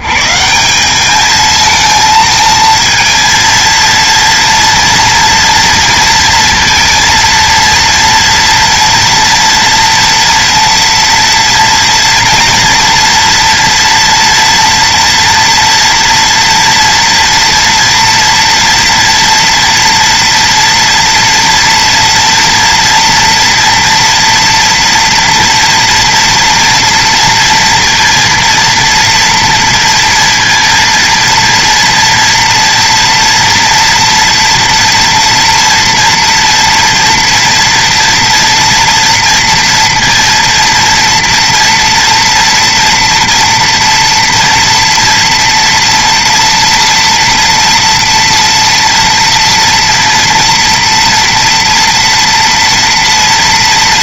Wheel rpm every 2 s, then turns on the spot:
80, 220, 230, 230, 230, 230, 230, 230, 230, 240, 230, 230, 240, 230, 230, 230, 240, 240, 240, 230, 230, 230, 230, 230, 230, 230, 230.
none